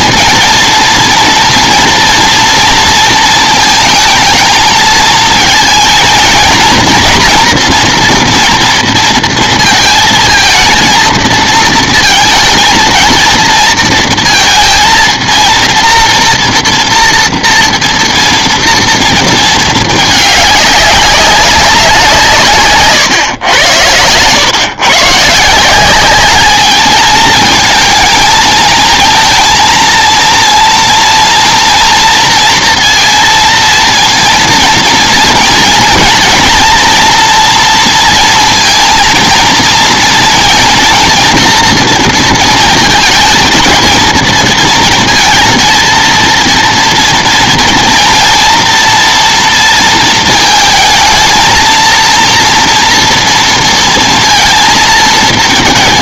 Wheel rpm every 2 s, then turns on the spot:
230, 230, 220, 230, 230, 230, 230, 230, 230, 230, 210, 150, 120, 210, 220, 230, 230, 230, 240, 230, 230, 230, 230, 230, 230, 220, 230, 230.
none